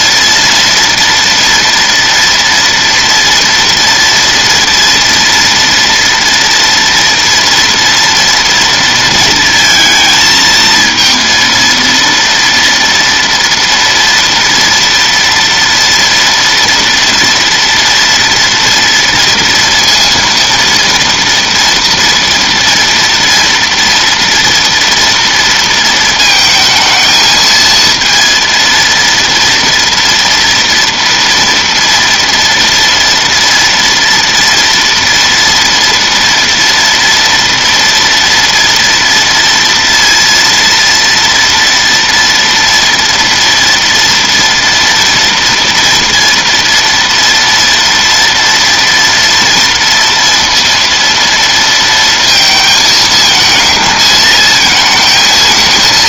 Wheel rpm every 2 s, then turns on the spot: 230, 230, 240, 230, 230, 230, 230, 230, 230, 240, 230, 230, 230, 220, 230, 230, 230, 230, 230, 230, 230, 230, 230, 230, 230, 230, 220, 220.
none